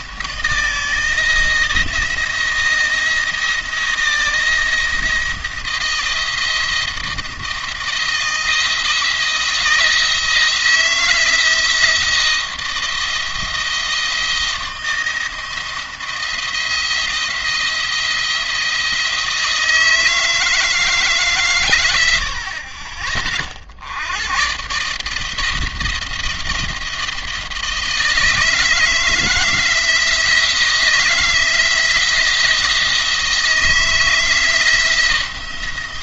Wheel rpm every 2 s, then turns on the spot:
160, 170, 170, 160, 170, 170, 170, 170, 170, 170, 160, 50, 140, 170, 160, 170, 160, 170.
none